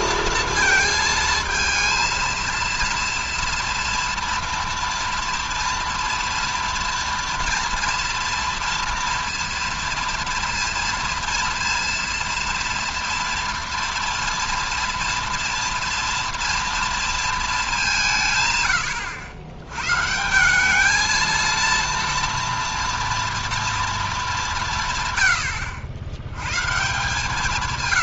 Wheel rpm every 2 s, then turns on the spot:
230, 230, 240, 230, 230, 230, 230, 240, 230, 120, 190, 240, 200, 120.
none